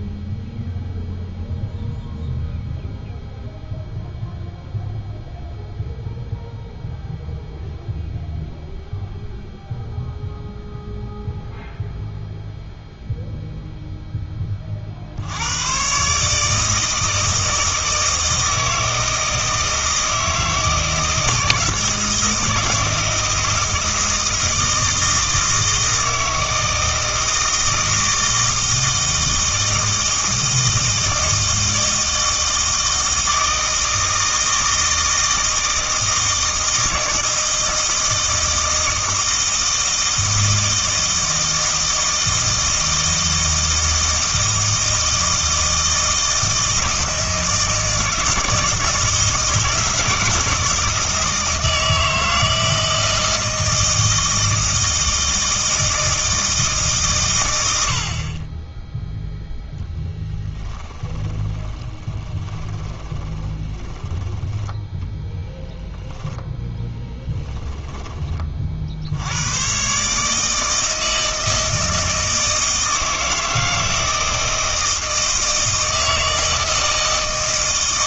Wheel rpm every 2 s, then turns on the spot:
0, 0, 0, 0, 0, 0, 0, 50, 160, 160, 160, 160, 160, 160, 160, 160, 160, 160, 160, 160, 160, 160, 160, 160, 160, 160, 160, 160, 150, 10, 10, 20, 10, 10, 60, 160, 160, 160, 160.
60-64 66-68